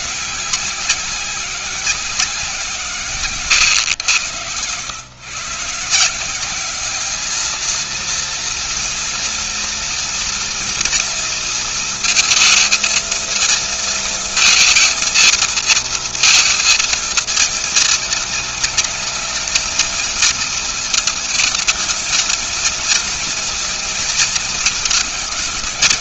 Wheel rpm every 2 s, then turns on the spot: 190, 180, 120, 180, 230, 230, 230, 220, 230, 220, 220, 230, 220.
none